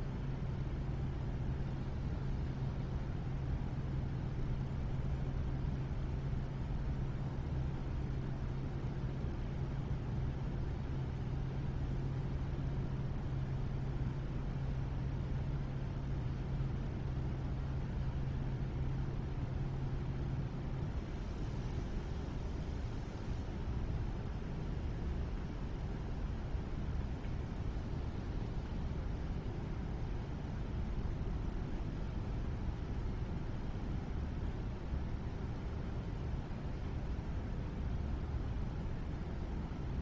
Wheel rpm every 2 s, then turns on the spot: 0, 0, 0, 0, 0, 0, 0, 0, 0, 0, 0, 0, 0, 0, 0, 0, 0, 0, 0, 0.
none